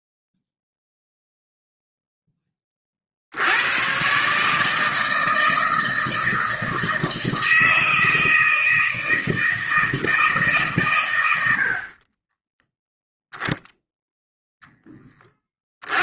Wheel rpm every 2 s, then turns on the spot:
0, 20, 150, 160, 160, 140, 20, 0.
12-14